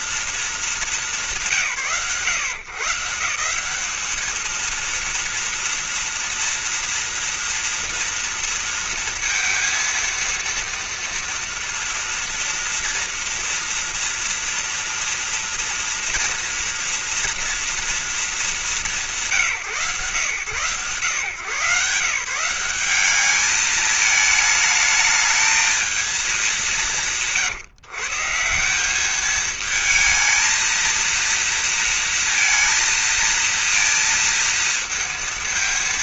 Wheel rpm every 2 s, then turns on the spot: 220, 140, 230, 240, 230, 230, 230, 230, 230, 170, 130, 200, 220, 160, 210, 230, 230, 230.
none